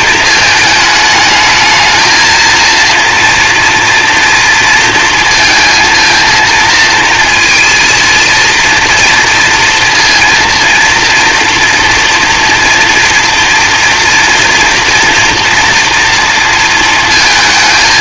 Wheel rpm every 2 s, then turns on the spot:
220, 230, 230, 230, 230, 230, 240, 230, 230.
none